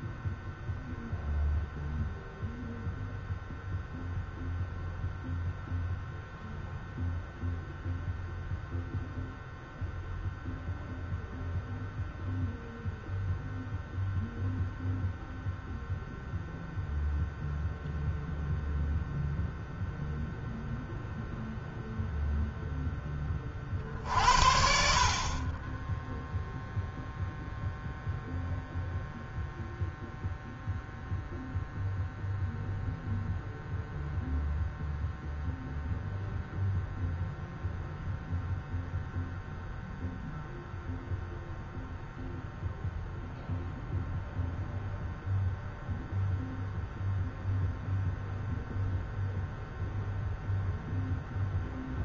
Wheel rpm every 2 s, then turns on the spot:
0, 0, 0, 0, 0, 0, 0, 0, 0, 0, 0, 0, 60, 0, 0, 0, 0, 0, 0, 0, 0, 0, 0, 0, 0, 0.
none